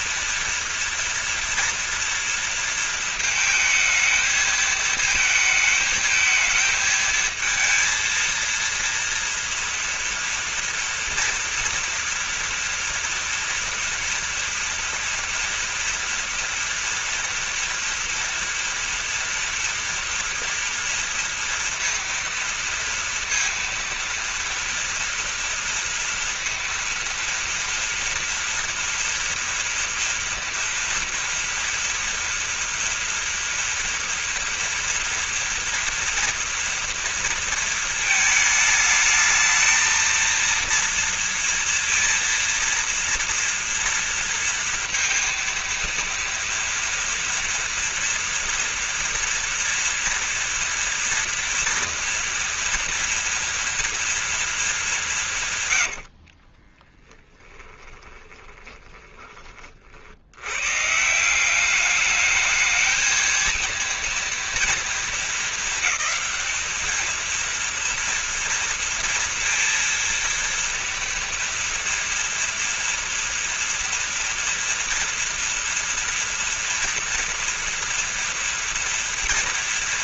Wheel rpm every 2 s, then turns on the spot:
230, 230, 220, 220, 230, 230, 230, 230, 230, 230, 230, 230, 230, 230, 230, 230, 230, 240, 230, 220, 230, 230, 230, 230, 230, 230, 240, 220, 50, 20, 110, 220, 230, 220, 230, 230, 230, 230, 230, 230.
56-60